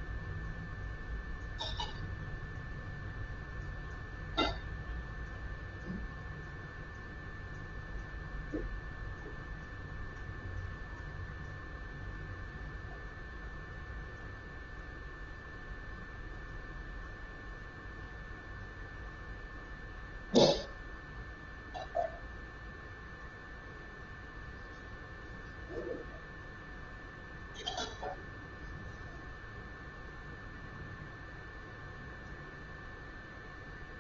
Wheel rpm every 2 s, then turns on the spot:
0, 0, 0, 0, 0, 0, 0, 0, 0, 0, 0, 0, 0, 0, 0, 0, 0.
none